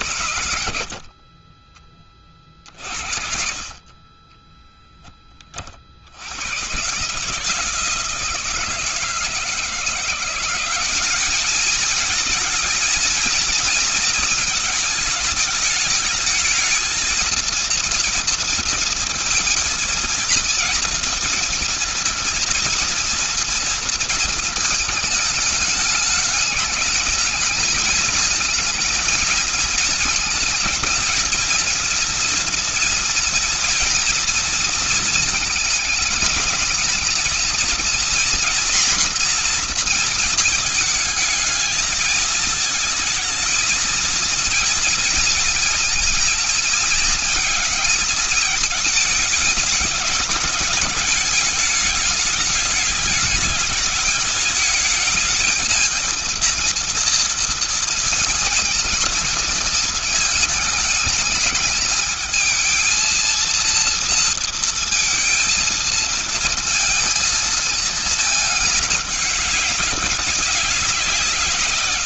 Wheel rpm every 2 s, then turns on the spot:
50, 50, 10, 140, 160, 190, 220, 220, 220, 230, 230, 230, 220, 210, 220, 220, 240, 230, 210, 240, 220, 220, 230, 220, 220, 210, 210, 220, 230, 220, 220, 230, 230, 230, 210, 180.
none